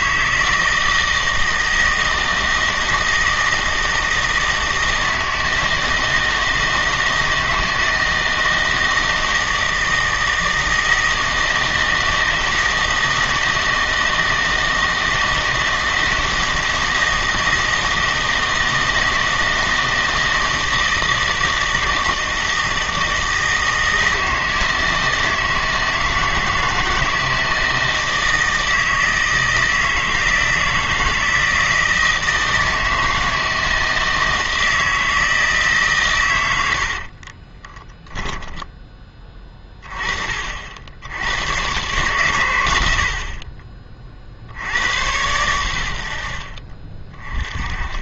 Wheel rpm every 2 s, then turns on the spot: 160, 160, 160, 160, 160, 160, 160, 160, 160, 160, 160, 160, 160, 160, 160, 160, 160, 160, 80, 10, 60, 80, 70, 50.
36-38